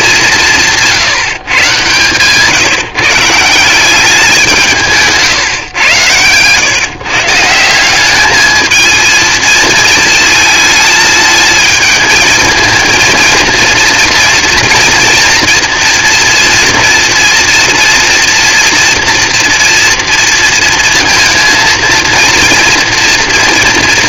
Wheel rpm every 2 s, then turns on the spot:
160, 160, 170, 120, 220, 220, 220, 230, 230, 240, 230, 230.
none